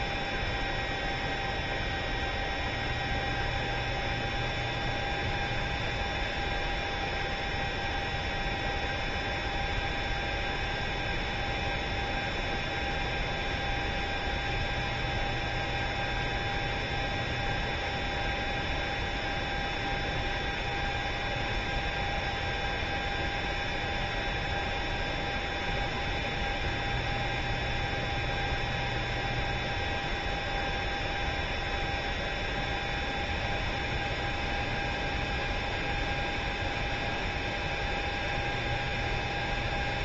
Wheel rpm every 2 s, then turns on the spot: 0, 0, 0, 0, 0, 0, 0, 0, 0, 0, 0, 0, 0, 0, 0, 0, 0, 0, 0, 0.
none